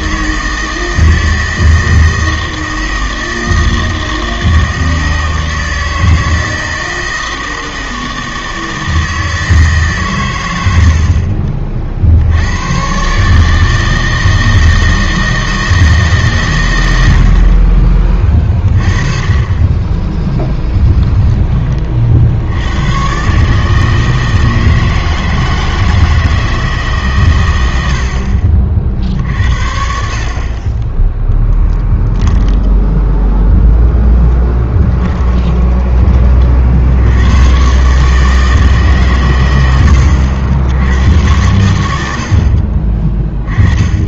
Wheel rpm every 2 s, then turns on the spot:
160, 160, 160, 160, 160, 80, 110, 160, 110, 20, 10, 100, 160, 150, 50, 20, 10, 10, 60, 150, 80, 50.
20-22 34-36